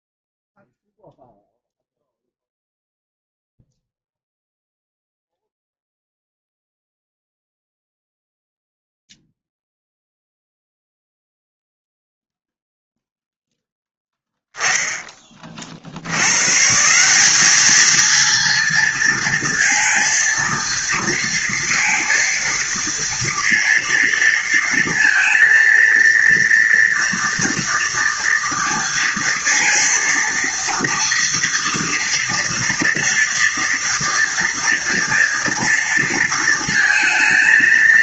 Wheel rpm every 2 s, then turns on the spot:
0, 0, 0, 0, 0, 0, 0, 10, 130, 230, 230, 230, 230, 230, 230, 230, 230, 230, 230.
none